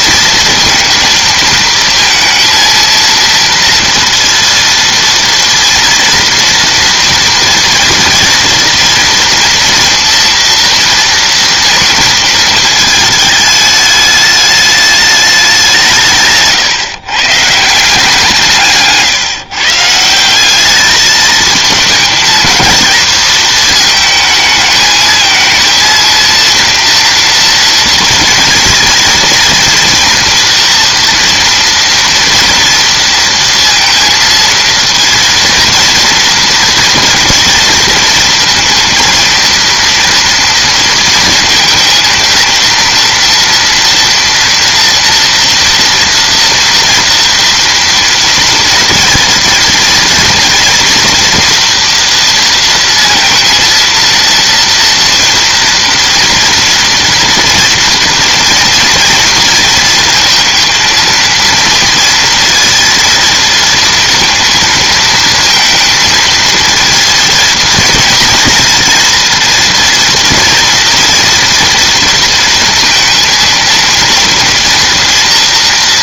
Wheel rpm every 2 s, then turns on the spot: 230, 230, 230, 230, 230, 230, 220, 210, 140, 160, 200, 230, 220, 230, 230, 230, 230, 230, 230, 230, 230, 230, 230, 230, 230, 230, 230, 230, 240, 230, 230, 230, 220, 220, 230, 230, 230, 230.
none